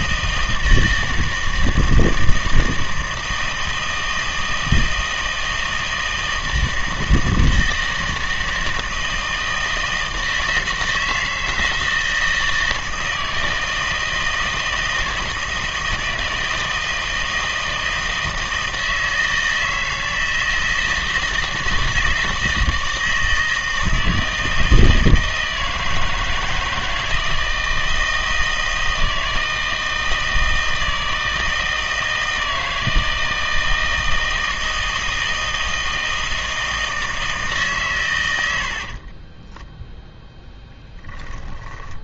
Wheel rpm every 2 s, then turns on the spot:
160, 160, 160, 160, 160, 160, 160, 160, 160, 160, 160, 160, 160, 160, 160, 160, 160, 160, 160, 60, 10.
38-42